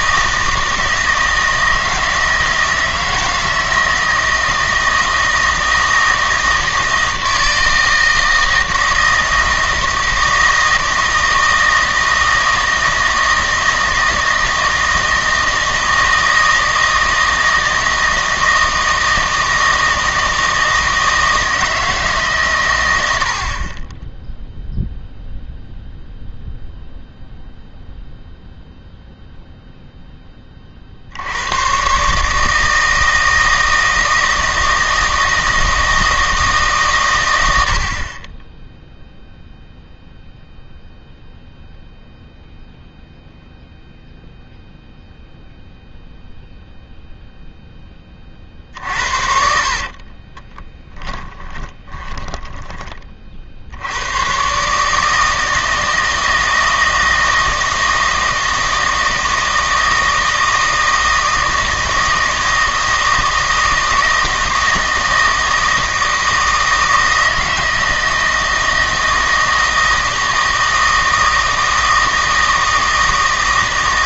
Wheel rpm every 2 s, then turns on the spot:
160, 160, 160, 160, 160, 160, 160, 160, 160, 160, 160, 130, 0, 0, 0, 40, 160, 160, 150, 10, 0, 0, 0, 0, 40, 20, 20, 140, 160, 160, 160, 160, 160, 160, 160, 160, 160.
48-54